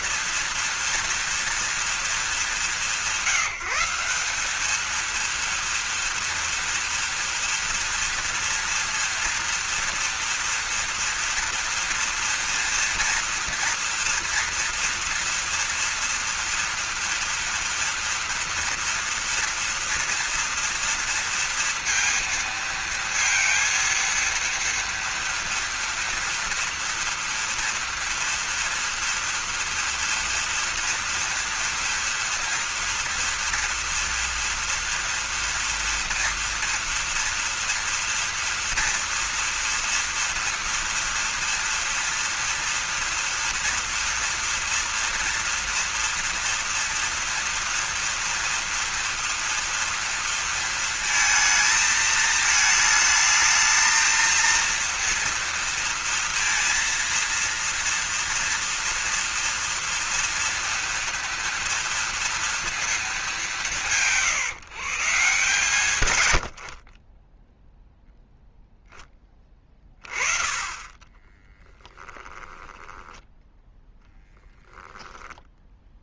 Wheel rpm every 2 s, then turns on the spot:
230, 180, 220, 230, 230, 230, 240, 230, 230, 230, 230, 230, 230, 230, 230, 230, 230, 240, 230, 230, 230, 230, 230, 230, 230, 230, 220, 230, 230, 230, 230, 210, 150, 40, 0, 20, 10, 10.
70-74